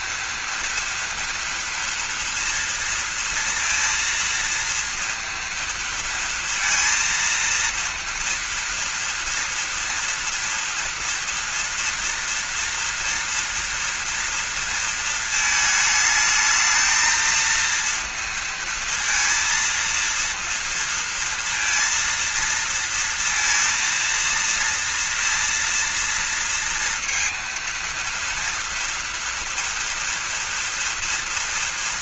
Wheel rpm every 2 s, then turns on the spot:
230, 230, 230, 230, 230, 240, 230, 230, 220, 230, 230, 230, 230, 230, 230, 230.
none